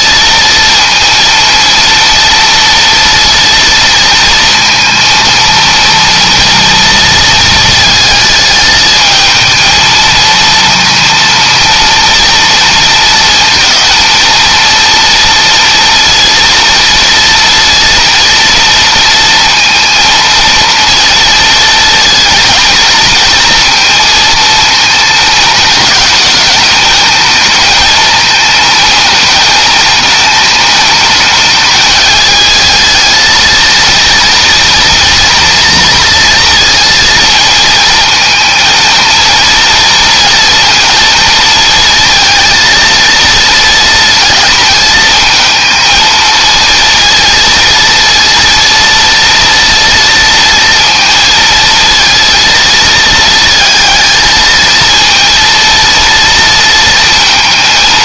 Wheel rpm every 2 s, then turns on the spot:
230, 230, 230, 230, 220, 230, 230, 230, 230, 230, 230, 220, 220, 210, 220, 220, 220, 230, 230, 230, 230, 230, 220, 230, 230, 230, 230, 230, 230.
none